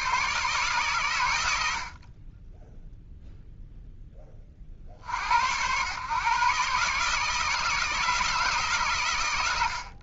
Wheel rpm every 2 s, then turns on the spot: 130, 10, 50, 140, 130.
none